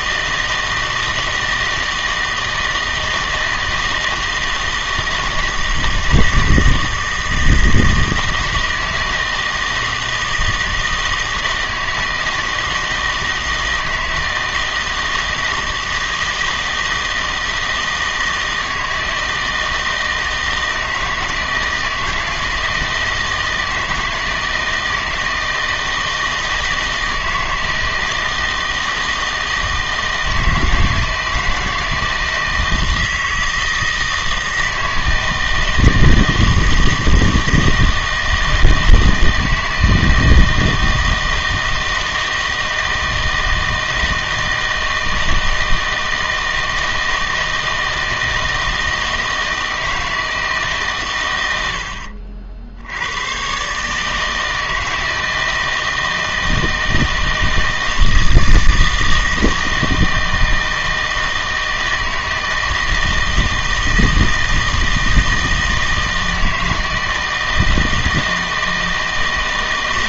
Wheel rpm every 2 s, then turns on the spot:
160, 160, 160, 160, 160, 160, 160, 160, 160, 160, 160, 160, 160, 160, 160, 160, 160, 160, 160, 160, 160, 160, 160, 160, 160, 150, 70, 160, 160, 160, 160, 160, 160, 160, 160.
none